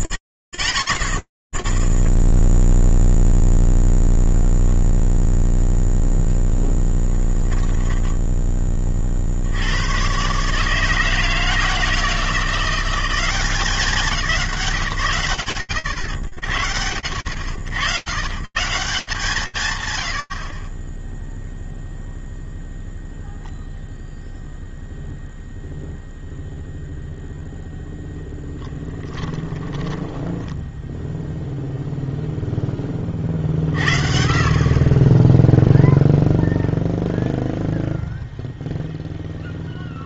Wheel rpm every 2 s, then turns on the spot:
0, 0, 0, 10, 30, 160, 180, 130, 90, 170, 0, 0, 0, 0, 10, 0, 50, 0, 0, 0.
6-8 28-30